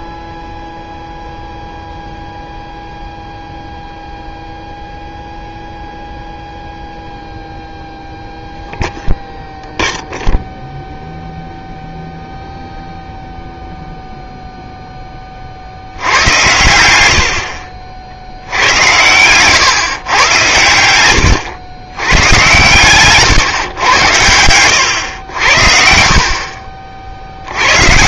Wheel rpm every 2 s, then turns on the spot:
0, 0, 0, 0, 0, 0, 0, 0, 110, 80, 100, 130, 100, 50.
16-18